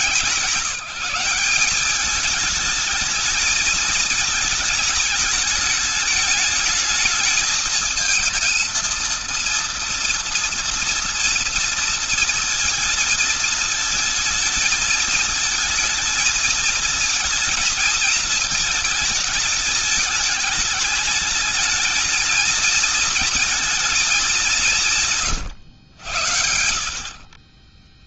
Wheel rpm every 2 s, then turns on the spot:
190, 220, 210, 210, 230, 230, 220, 230, 230, 220, 210, 230, 170, 60.
24-28